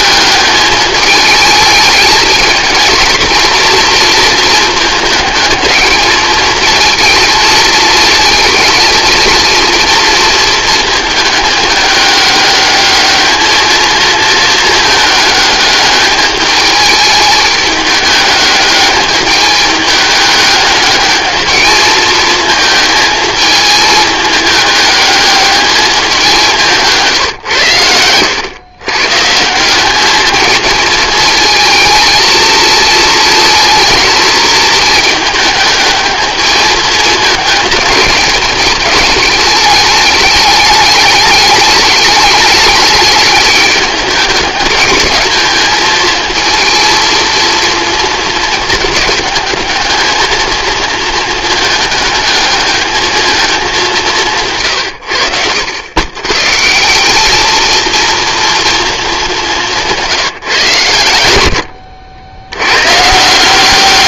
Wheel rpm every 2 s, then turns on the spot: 210, 230, 230, 220, 220, 220, 200, 220, 210, 210, 210, 220, 210, 170, 110, 220, 230, 220, 220, 210, 210, 210, 200, 220, 220, 220, 210, 150, 140, 230, 130, 100.
none